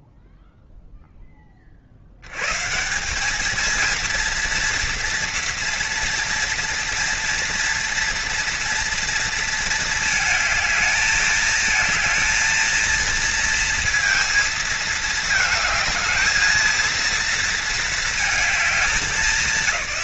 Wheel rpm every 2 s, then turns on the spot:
10, 190, 230, 240, 230, 220, 230, 220, 230, 210.
none